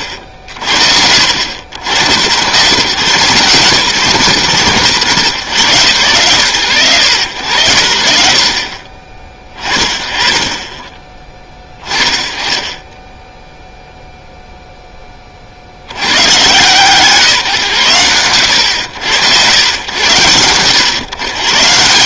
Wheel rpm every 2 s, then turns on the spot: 60, 130, 130, 100, 70, 20, 30, 10, 140, 80, 120.
none